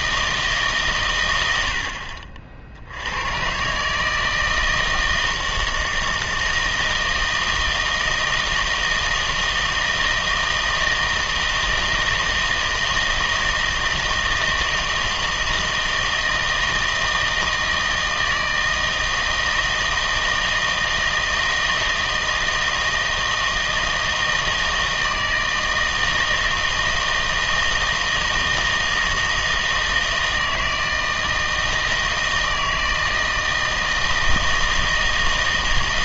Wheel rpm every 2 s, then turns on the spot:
140, 70, 160, 160, 160, 160, 160, 160, 160, 160, 160, 160, 160, 160, 160, 160, 160, 160.
none